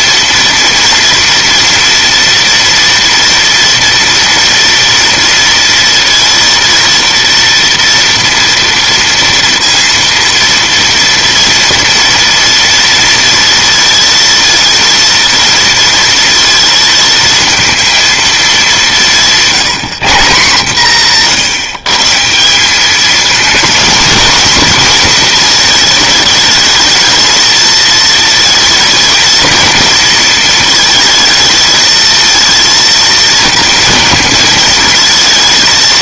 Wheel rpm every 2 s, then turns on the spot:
230, 230, 230, 230, 230, 230, 230, 230, 230, 200, 160, 190, 240, 220, 220, 220, 230, 220.
none